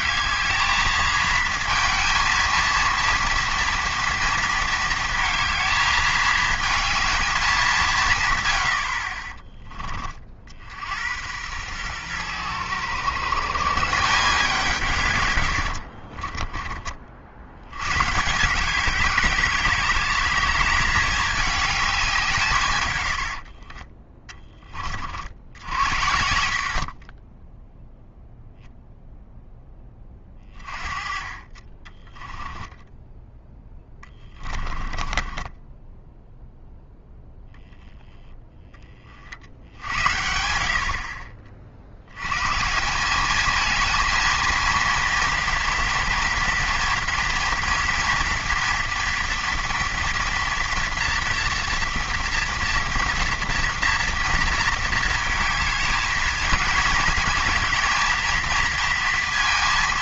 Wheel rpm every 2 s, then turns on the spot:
220, 230, 230, 220, 90, 70, 110, 170, 30, 180, 210, 140, 30, 60, 0, 30, 10, 20, 0, 20, 70, 140, 230, 230, 240, 240, 230, 230, 230, 230.
32-36